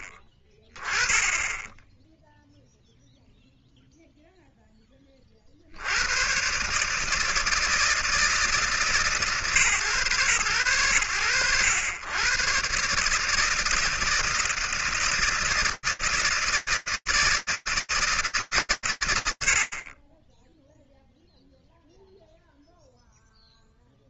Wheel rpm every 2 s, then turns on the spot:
10, 0, 40, 160, 140, 90, 150, 160, 160, 100, 0, 0.
none